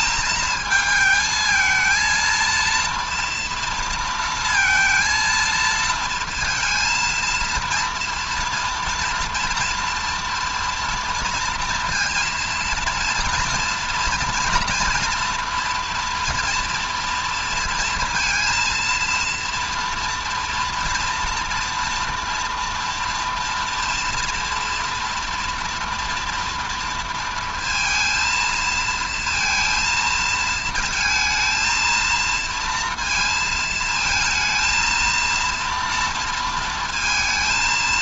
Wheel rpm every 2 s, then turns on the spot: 220, 230, 230, 230, 230, 230, 230, 230, 230, 230, 230, 230, 230, 230, 230, 230, 230, 230, 230.
none